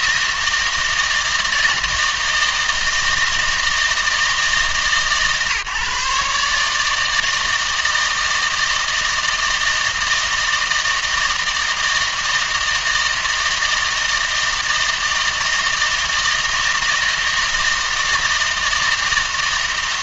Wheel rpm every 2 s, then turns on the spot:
160, 160, 150, 150, 160, 160, 160, 160, 160, 160.
none